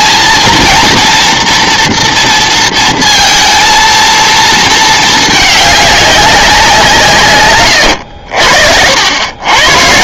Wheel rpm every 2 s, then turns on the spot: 230, 230, 220, 170, 70.
none